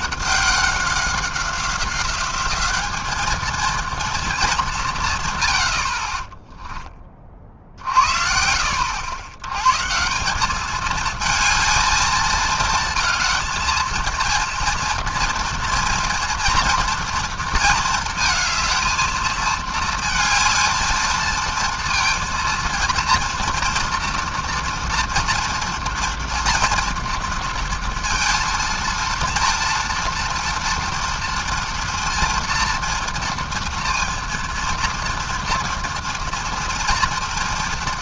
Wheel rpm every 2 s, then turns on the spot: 190, 200, 200, 20, 70, 200, 220, 230, 230, 220, 220, 230, 230, 240, 230, 230, 230, 230, 240.
6-8